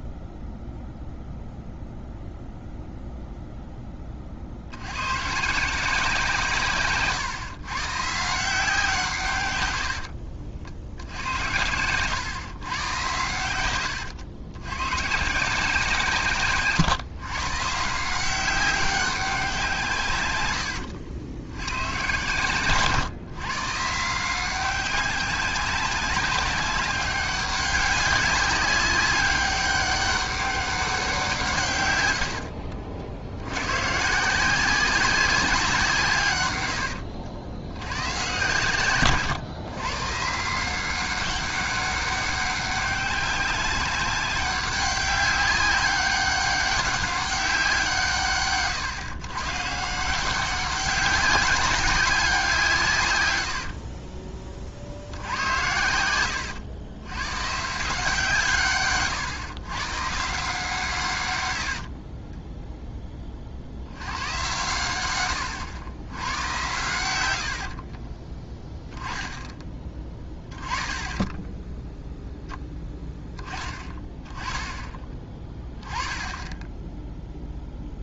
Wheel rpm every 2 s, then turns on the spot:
0, 0, 70, 150, 160, 60, 120, 110, 140, 190, 100, 130, 190, 200, 200, 200, 70, 180, 100, 130, 170, 190, 190, 190, 130, 190, 160, 50, 100, 140, 150, 10, 110, 110, 10, 20, 0, 20, 10.
20-22 32-34 36-38 62-64